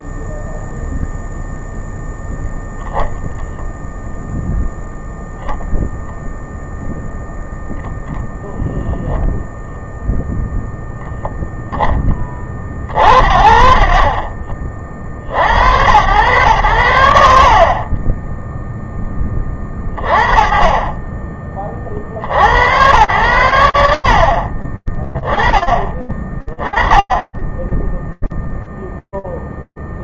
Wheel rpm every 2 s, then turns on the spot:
0, 0, 0, 0, 0, 0, 40, 30, 90, 10, 20, 90, 30, 20, 0.
none